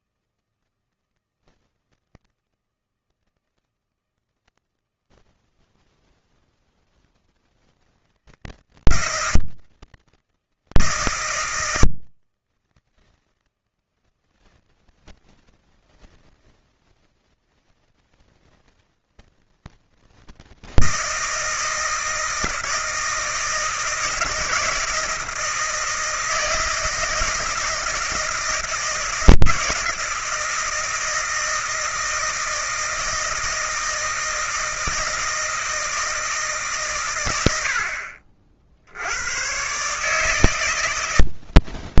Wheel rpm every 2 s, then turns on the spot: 160, 160, 160, 160, 160, 160, 160, 160, 160, 160, 160, 160, 160, 160, 160, 160, 160, 160, 140, 70, 160.
none